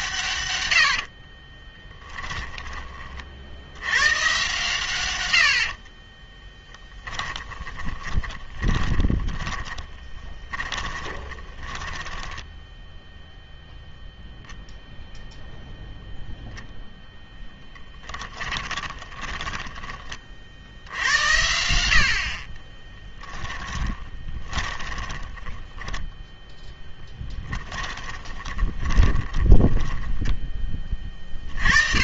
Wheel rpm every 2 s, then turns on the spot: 90, 20, 140, 10, 20, 20, 10, 0, 0, 20, 70, 30, 20, 10, 20, 20.
0-2 6-14 18-20 22-26 28-30